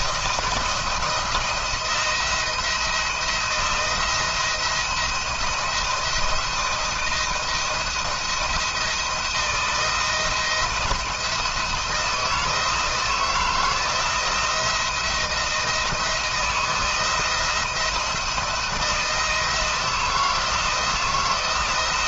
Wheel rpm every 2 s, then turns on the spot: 170, 170, 160, 170, 170, 170, 160, 170, 170, 170, 170.
none